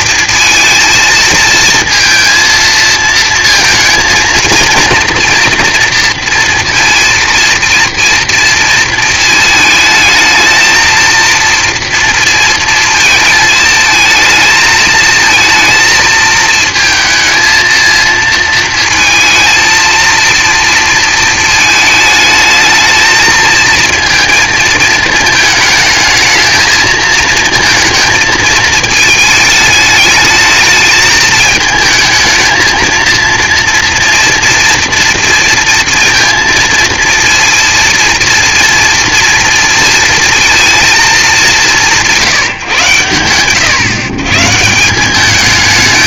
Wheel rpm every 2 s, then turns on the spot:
230, 220, 230, 230, 230, 220, 230, 220, 220, 230, 230, 220, 230, 220, 220, 210, 220, 230, 230, 230, 230, 140, 150.
none